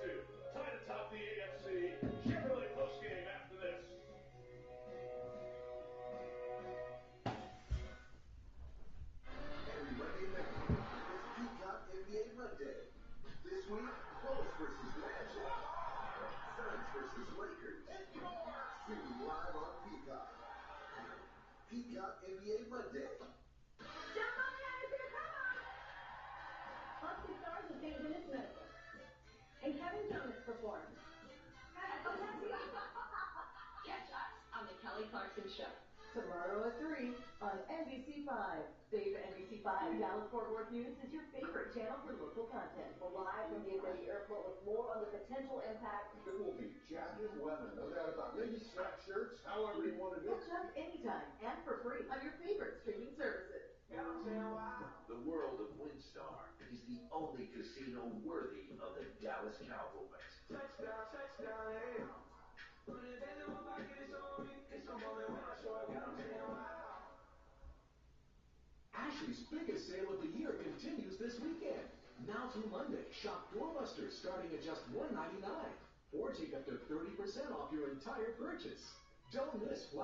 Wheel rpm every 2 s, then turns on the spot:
0, 0, 0, 0, 0, 0, 0, 0, 0, 0, 0, 0, 0, 0, 0, 0, 0, 0, 0, 0, 0, 0, 0, 0, 0, 0, 0, 0, 0, 0, 0, 0, 0, 0, 0, 0, 0, 0, 0, 0.
none